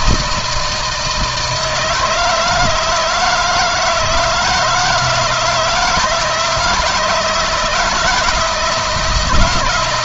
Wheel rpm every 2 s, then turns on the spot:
160, 160, 160, 160, 170.
none